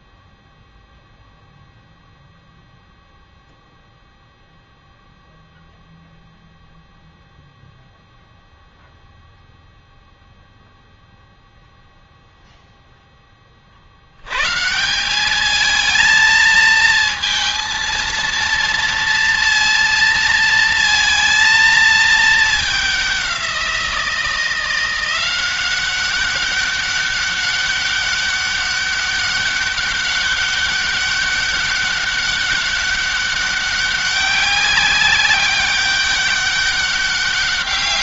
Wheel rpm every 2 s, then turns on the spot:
0, 0, 0, 0, 0, 0, 0, 160, 220, 230, 230, 200, 170, 200, 200, 200, 200, 190, 200.
none